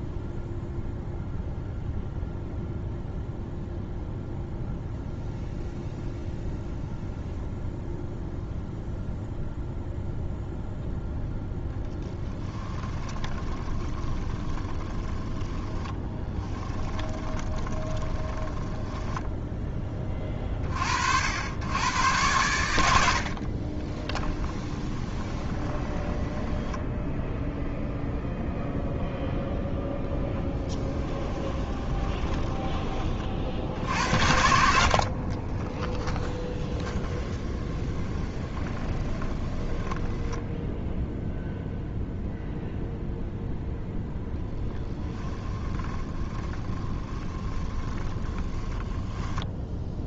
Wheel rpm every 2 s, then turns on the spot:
0, 0, 0, 0, 0, 0, 20, 20, 20, 10, 50, 80, 20, 10, 0, 10, 20, 60, 20, 20, 0, 0, 20, 20, 10.
12-20 24-28 30-32 36-40 44-50